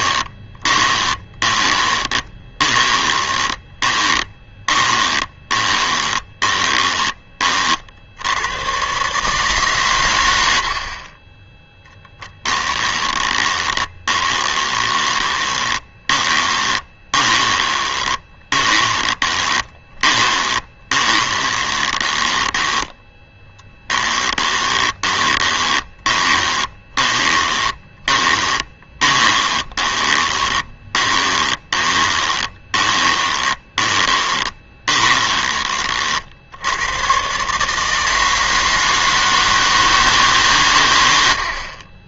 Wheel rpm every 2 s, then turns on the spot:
20, 20, 20, 20, 140, 60, 10, 20, 20, 20, 20, 10, 20, 20, 20, 20, 20, 20, 110, 160, 110.
0-6 12-36